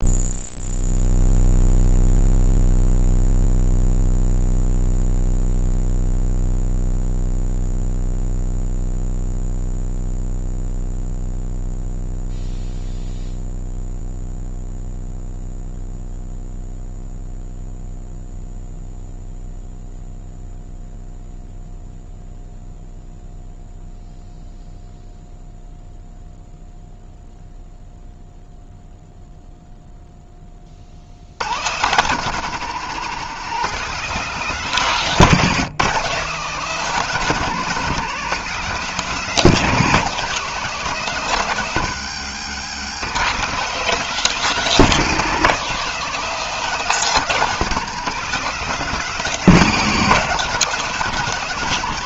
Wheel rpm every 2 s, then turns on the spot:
0, 0, 0, 0, 0, 0, 0, 0, 0, 0, 0, 0, 0, 0, 0, 100, 180, 170, 190, 190, 170, 170, 190, 200, 200, 190.
none